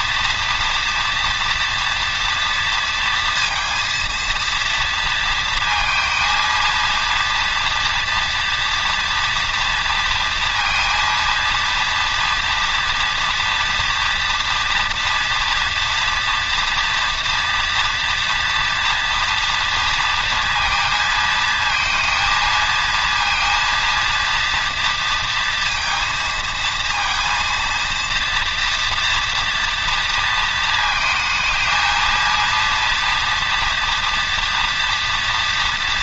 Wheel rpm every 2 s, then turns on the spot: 230, 230, 230, 230, 230, 230, 230, 240, 230, 240, 230, 230, 230, 230, 230, 230, 230, 240.
none